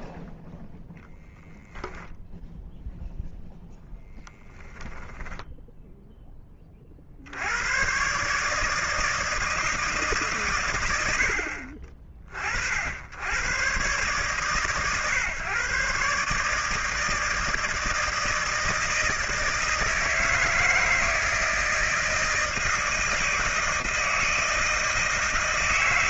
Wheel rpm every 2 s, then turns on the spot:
0, 0, 0, 40, 160, 110, 60, 130, 150, 160, 160, 160, 160.
none